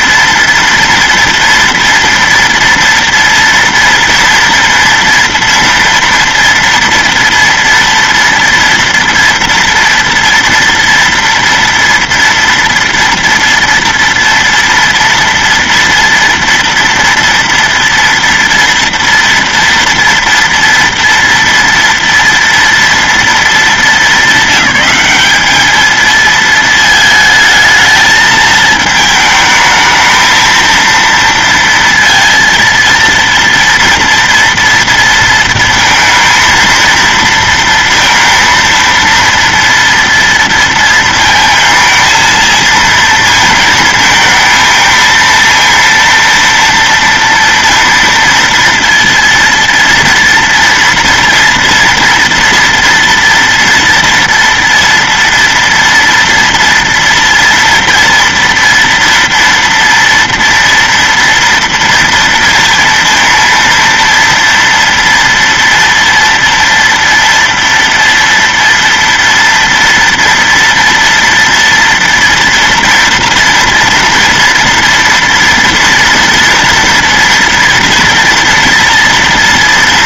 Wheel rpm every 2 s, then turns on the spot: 230, 230, 230, 230, 230, 230, 230, 230, 230, 230, 230, 230, 210, 220, 220, 220, 230, 230, 230, 230, 230, 230, 220, 230, 230, 230, 230, 230, 230, 230, 230, 230, 230, 230, 240, 230, 240, 230, 230, 230.
none